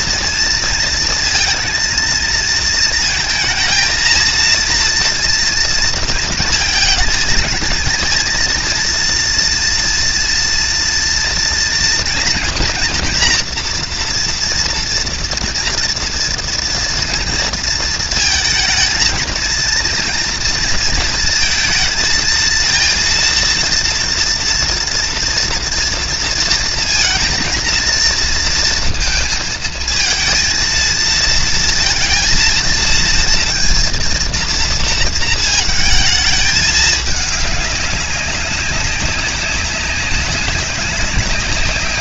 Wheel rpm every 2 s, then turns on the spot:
230, 220, 230, 230, 230, 230, 230, 230, 230, 230, 230, 230, 230, 230, 220, 230, 230, 230, 210, 200, 200.
none